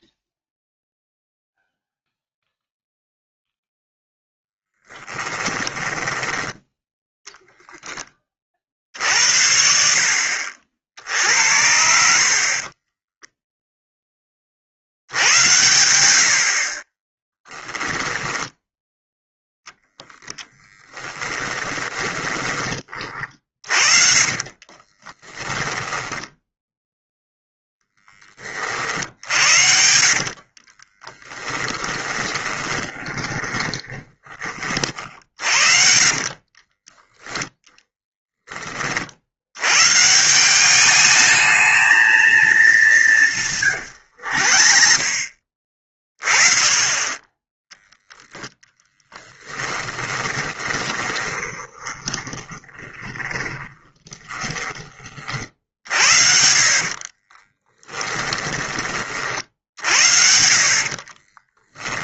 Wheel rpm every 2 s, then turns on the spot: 0, 0, 0, 20, 30, 60, 50, 60, 40, 10, 10, 30, 30, 0, 50, 20, 20, 40, 20, 50, 200, 190, 40, 20, 10, 20, 10, 30, 40, 20, 40.
6-8 18-26 30-38 48-54 56-58 60-62